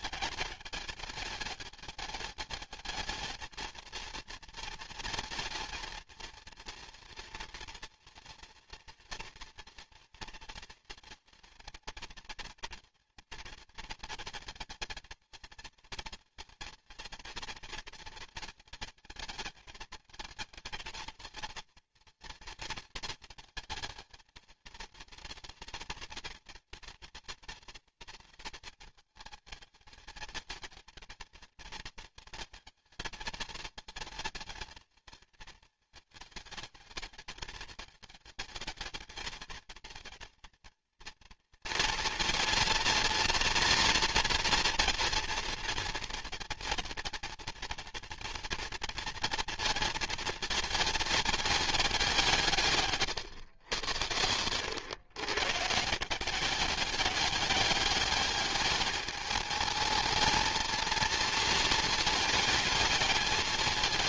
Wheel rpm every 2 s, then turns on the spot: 210, 210, 230, 230, 230, 230, 220, 230, 230, 220, 220, 220, 220, 230, 220, 230, 220, 220, 210, 220, 230, 230, 230, 230, 230, 220, 140, 110, 200, 210, 230, 210.
none